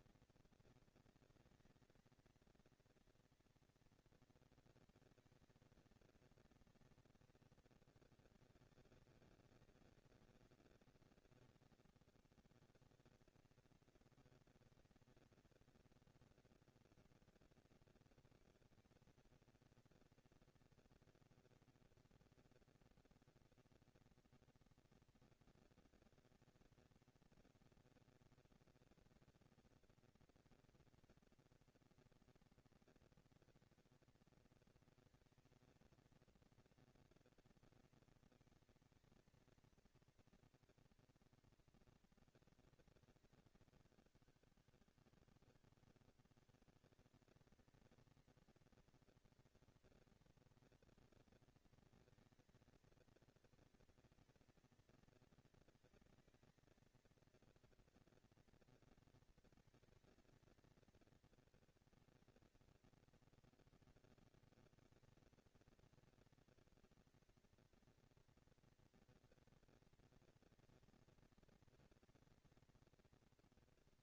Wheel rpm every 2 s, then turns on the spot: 230, 230, 230, 230, 210, 200, 210, 230, 230, 230, 230, 230, 230, 230, 240, 240, 230, 230, 230, 220, 230, 210, 170, 190, 230, 230, 230, 230, 230, 230, 230, 220, 230, 220, 230, 230, 230.
none